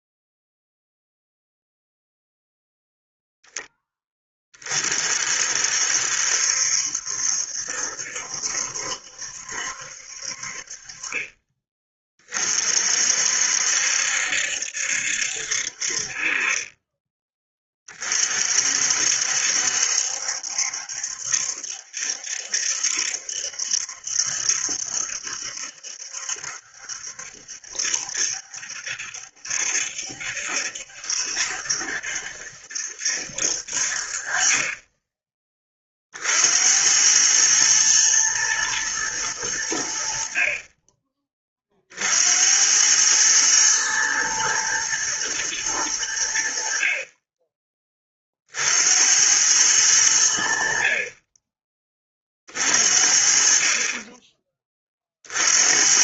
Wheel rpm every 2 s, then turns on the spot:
0, 0, 30, 70, 70, 50, 40, 70, 30, 50, 70, 70, 70, 70, 70, 70, 70, 30, 70, 110, 40, 90, 120, 60, 60, 60, 40, 20.
none